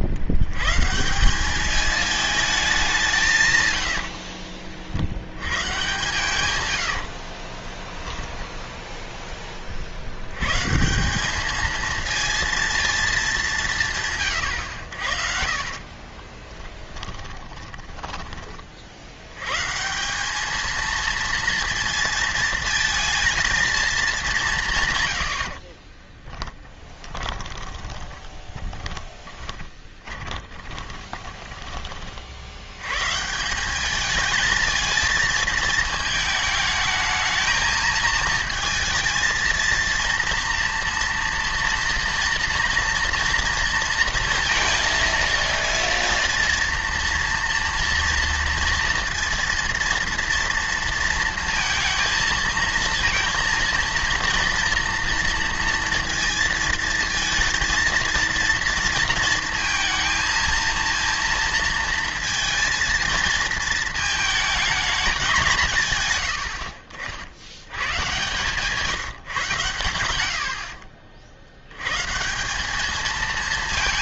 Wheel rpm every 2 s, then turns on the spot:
120, 200, 50, 100, 10, 140, 230, 90, 10, 40, 220, 230, 170, 20, 20, 20, 90, 220, 220, 230, 230, 230, 230, 230, 230, 230, 220, 230, 230, 230, 230, 230, 220, 60, 140, 60, 200.
6-8 16-18 26-32 70-72